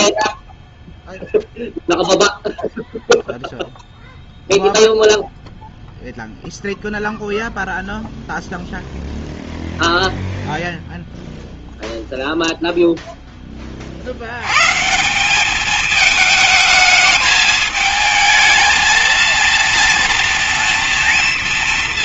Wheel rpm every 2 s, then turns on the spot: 0, 0, 0, 0, 0, 0, 0, 170, 220, 220, 230.
none